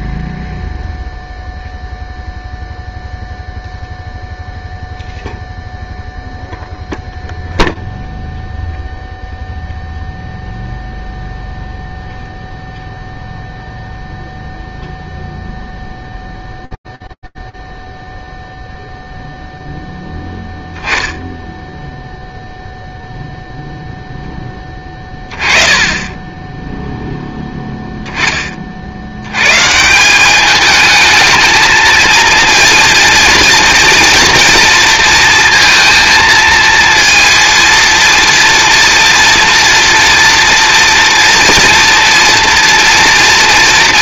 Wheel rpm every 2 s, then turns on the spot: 0, 0, 0, 0, 0, 0, 0, 0, 0, 0, 10, 0, 10, 10, 60, 220, 230, 230, 230, 230, 230, 230.
none